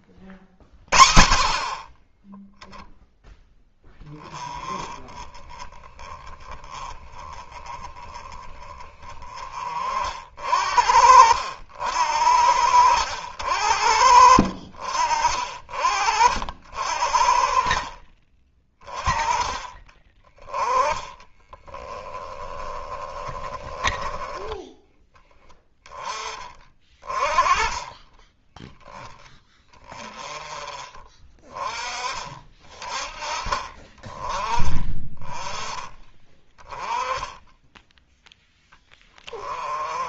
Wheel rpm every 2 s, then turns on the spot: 30, 0, 20, 30, 20, 60, 70, 60, 60, 30, 30, 20, 20, 20, 10, 20, 30, 20, 20, 10.
20-24